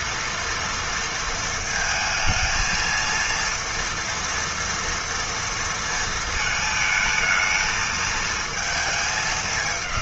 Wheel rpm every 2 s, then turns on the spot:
230, 230, 230, 220, 220.
none